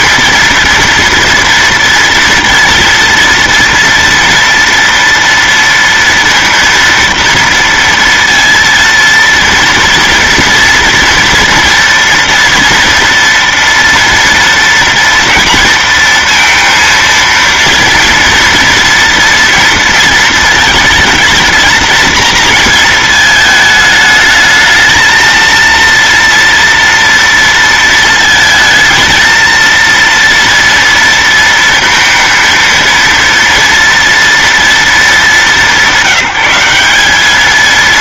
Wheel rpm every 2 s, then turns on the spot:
230, 230, 230, 230, 230, 230, 230, 230, 230, 240, 220, 220, 220, 230, 220, 230, 230, 220, 190.
none